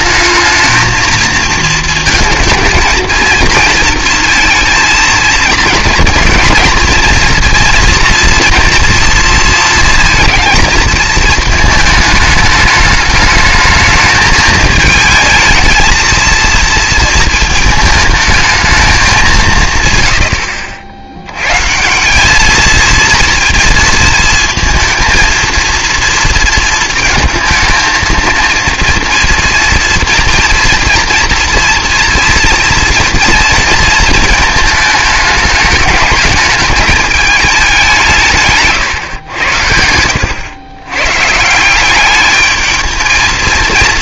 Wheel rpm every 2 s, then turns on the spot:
220, 230, 230, 230, 230, 220, 210, 220, 230, 220, 80, 230, 230, 230, 230, 230, 230, 220, 210, 130, 120, 220.
none